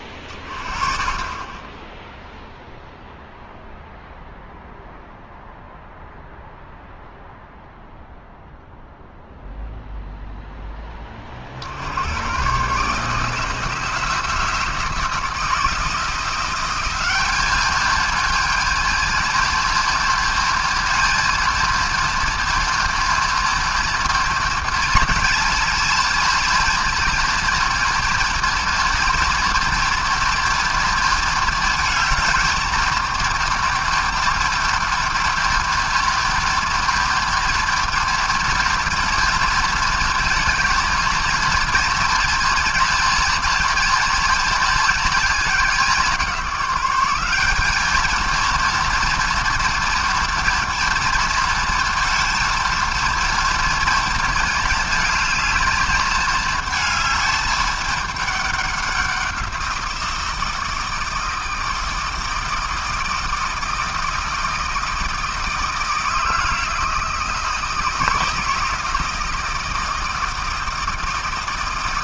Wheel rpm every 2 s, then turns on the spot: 30, 0, 0, 0, 0, 20, 150, 170, 200, 230, 230, 240, 230, 230, 230, 230, 230, 230, 230, 230, 230, 230, 220, 190, 230, 230, 230, 220, 220, 190, 160, 160, 160, 160, 160, 160.
none